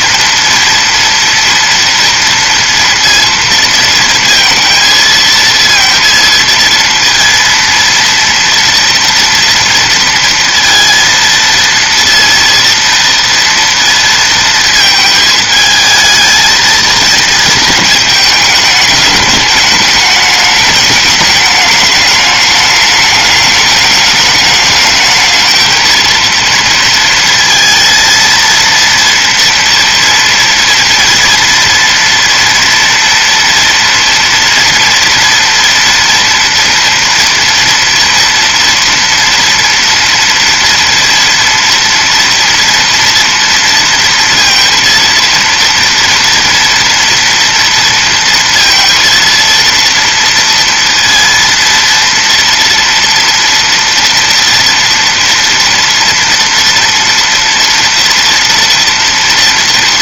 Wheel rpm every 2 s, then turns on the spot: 230, 230, 230, 230, 230, 230, 230, 220, 230, 210, 210, 210, 210, 230, 230, 230, 230, 230, 230, 230, 230, 230, 230, 230, 230, 230, 230, 230, 230, 230.
none